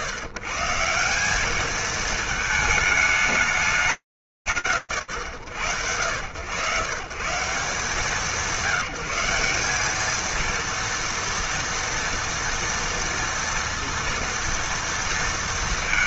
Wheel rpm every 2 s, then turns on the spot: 140, 220, 100, 160, 190, 230, 230, 230.
none